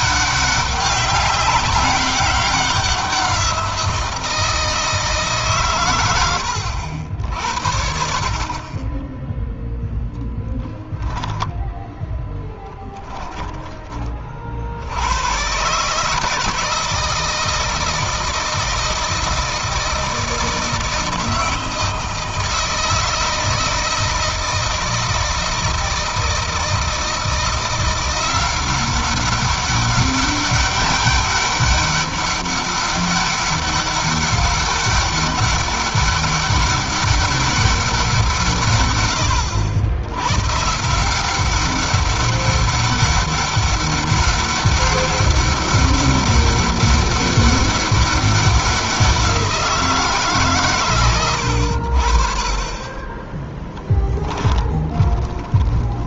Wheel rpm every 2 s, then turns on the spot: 190, 190, 160, 80, 30, 10, 10, 60, 160, 160, 160, 160, 160, 160, 180, 200, 200, 200, 200, 140, 140, 190, 200, 200, 190, 130, 20, 20.
10-14 54-56